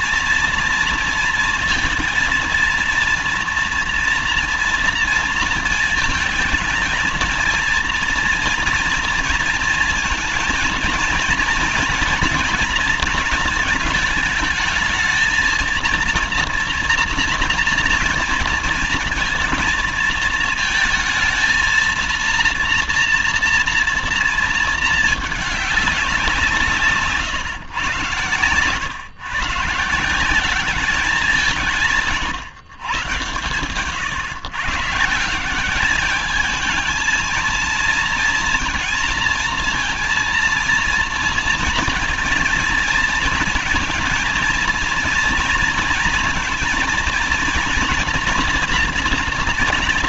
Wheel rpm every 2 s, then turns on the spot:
230, 230, 240, 220, 230, 220, 230, 220, 230, 230, 220, 230, 220, 170, 110, 190, 120, 150, 220, 230, 230, 230, 230, 230, 240.
none